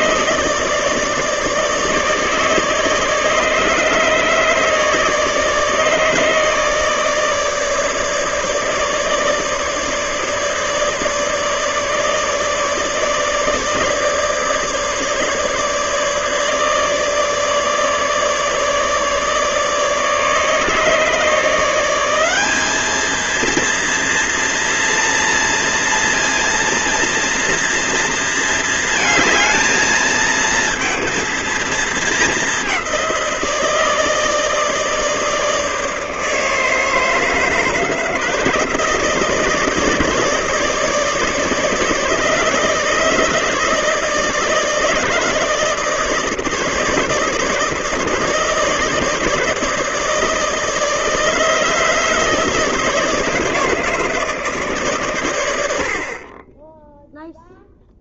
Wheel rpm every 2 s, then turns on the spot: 150, 150, 150, 150, 150, 150, 150, 150, 150, 150, 150, 200, 230, 230, 230, 230, 200, 150, 150, 150, 160, 150, 150, 160, 160, 150, 160, 150, 30.
none